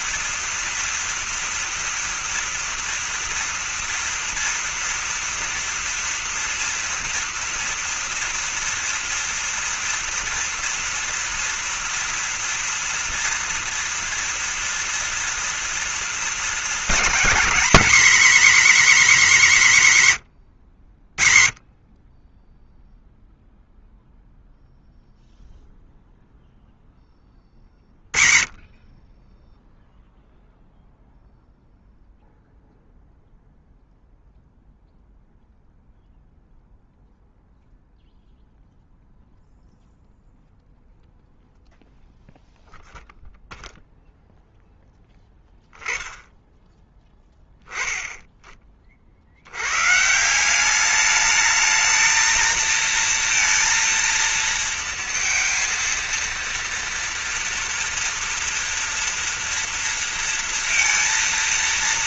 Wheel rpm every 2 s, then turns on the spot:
230, 230, 230, 240, 240, 230, 230, 230, 220, 260, 100, 10, 0, 0, 40, 0, 0, 0, 0, 0, 0, 0, 0, 10, 40, 180, 230, 230, 230, 230, 230.
46-48